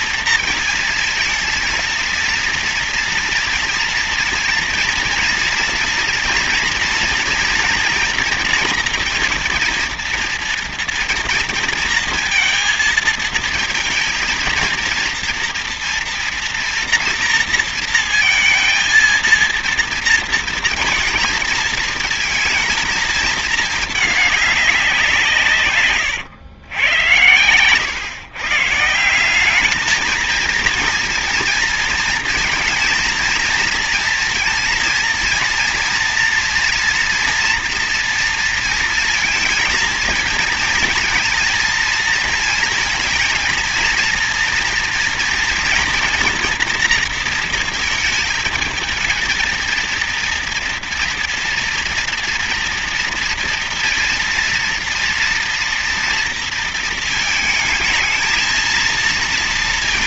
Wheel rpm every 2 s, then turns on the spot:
230, 230, 230, 240, 230, 230, 230, 230, 230, 230, 230, 230, 190, 110, 170, 230, 230, 230, 230, 230, 230, 220, 230, 230, 220, 230, 230, 230, 230, 230.
none